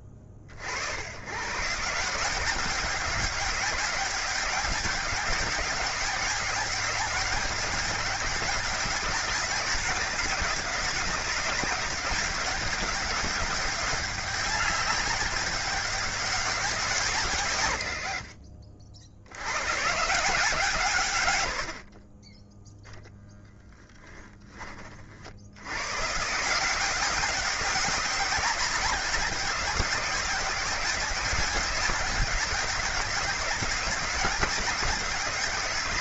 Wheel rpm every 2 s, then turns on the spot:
50, 200, 200, 200, 190, 200, 200, 200, 180, 70, 140, 0, 40, 180, 200, 200, 200, 190.
none